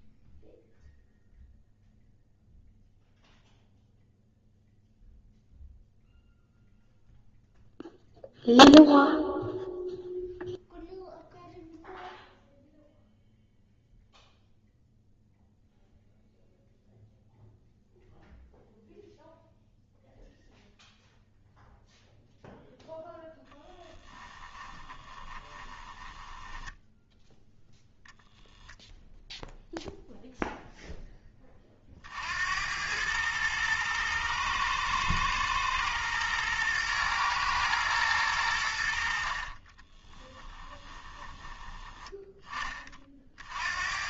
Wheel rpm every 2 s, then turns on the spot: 0, 0, 0, 0, 0, 0, 0, 0, 0, 0, 0, 0, 20, 10, 0, 0, 90, 110, 120, 80, 20, 20.
24-28 40-42